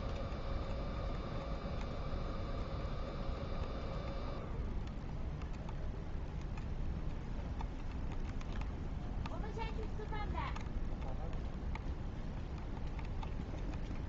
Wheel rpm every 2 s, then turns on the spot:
0, 0, 0, 0, 0, 0, 0.
none